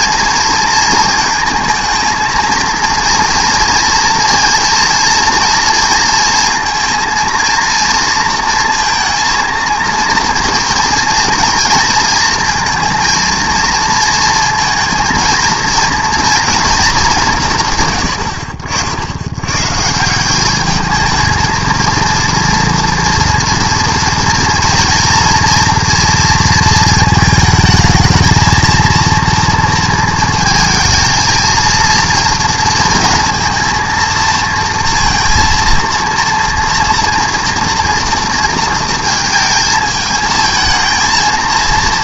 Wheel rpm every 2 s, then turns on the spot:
230, 230, 230, 230, 230, 230, 230, 230, 230, 70, 210, 230, 230, 230, 220, 220, 230, 230, 240, 230, 220.
none